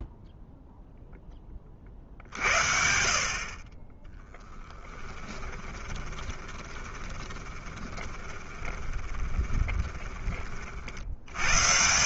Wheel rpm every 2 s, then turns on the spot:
0, 50, 10, 20, 20, 50.
4-10